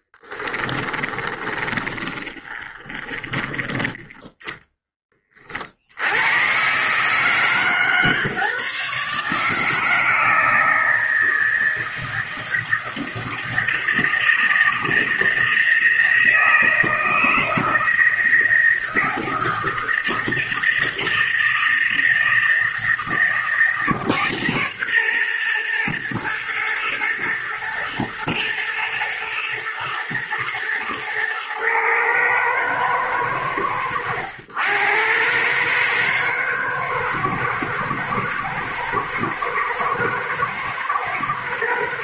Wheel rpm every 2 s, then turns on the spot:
20, 20, 10, 130, 140, 160, 160, 160, 160, 160, 160, 160, 140, 120, 120, 120, 110, 90, 110, 110, 110.
0-4